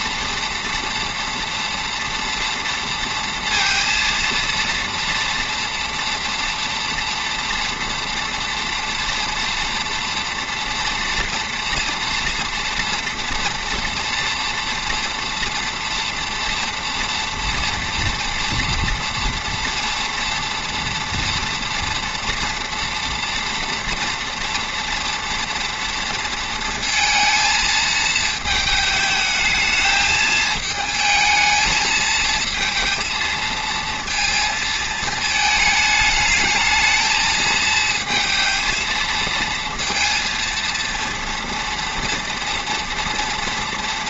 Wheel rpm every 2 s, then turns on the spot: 230, 230, 230, 230, 230, 230, 230, 230, 230, 230, 230, 240, 240, 230, 220, 220, 220, 220, 220, 220, 230, 230.
none